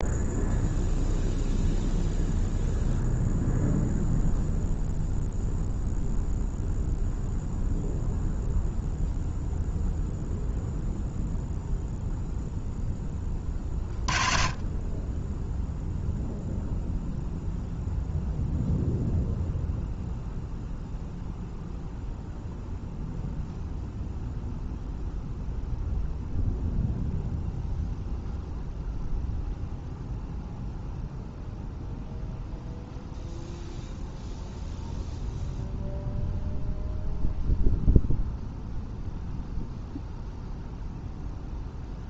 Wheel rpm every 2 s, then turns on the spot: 0, 0, 0, 0, 0, 0, 0, 30, 0, 0, 0, 0, 0, 0, 0, 0, 0, 0, 0, 0, 0.
none